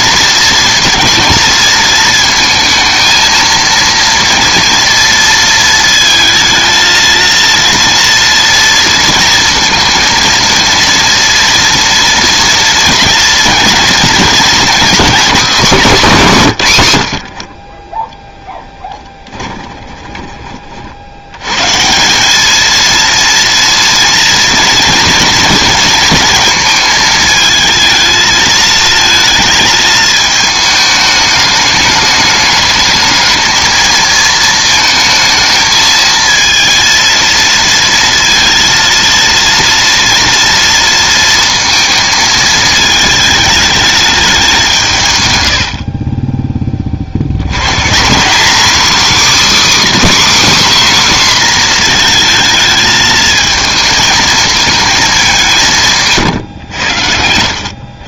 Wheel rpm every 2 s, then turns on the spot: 230, 230, 230, 220, 230, 230, 230, 230, 170, 10, 40, 220, 230, 220, 230, 220, 210, 220, 230, 230, 230, 220, 180, 20, 250, 290, 220, 220, 110.
18-20